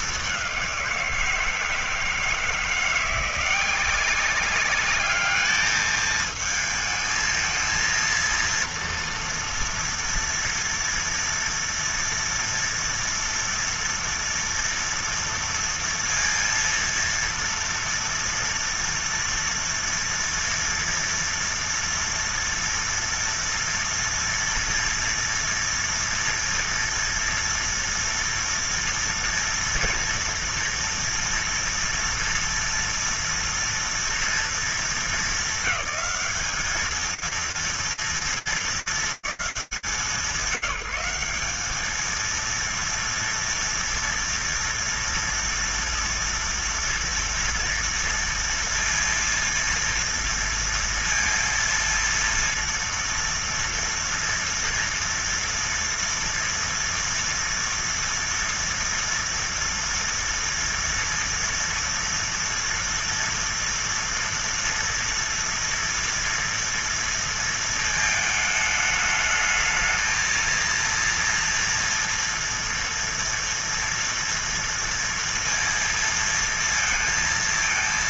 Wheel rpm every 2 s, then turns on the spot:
200, 160, 190, 220, 230, 230, 230, 240, 230, 230, 230, 230, 230, 240, 230, 240, 240, 230, 210, 220, 180, 230, 230, 230, 230, 230, 230, 230, 230, 230, 230, 230, 230, 230, 220, 230, 230, 230, 230.
none